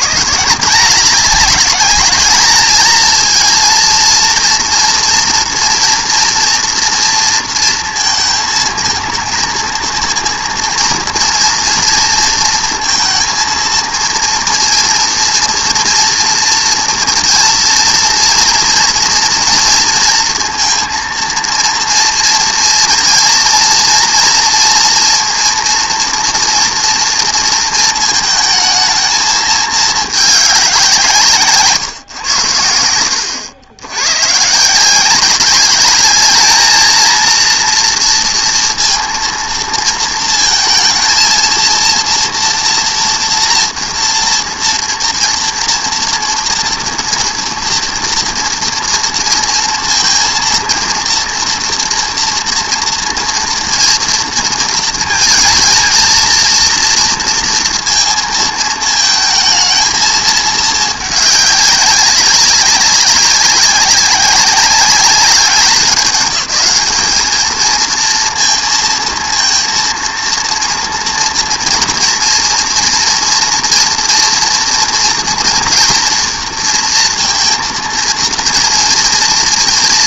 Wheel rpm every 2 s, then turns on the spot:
180, 220, 230, 230, 220, 230, 230, 230, 230, 230, 230, 230, 230, 240, 220, 200, 90, 170, 220, 230, 230, 230, 240, 240, 230, 230, 230, 220, 230, 220, 210, 200, 200, 220, 230, 230, 230, 240, 230, 230.
none